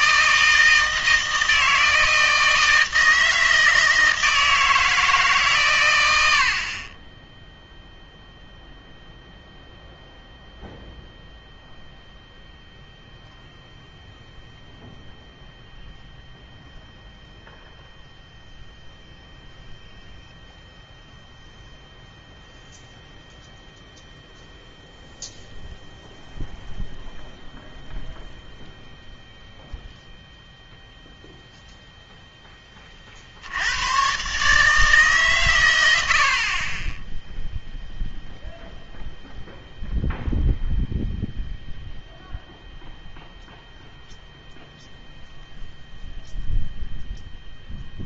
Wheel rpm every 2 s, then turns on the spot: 160, 160, 160, 60, 0, 0, 0, 0, 0, 0, 0, 0, 0, 0, 0, 0, 10, 150, 30, 0, 0, 0, 0, 0.
none